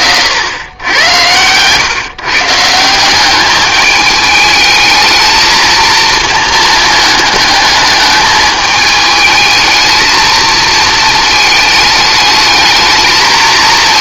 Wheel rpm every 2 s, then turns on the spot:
100, 170, 220, 220, 220, 220, 220.
none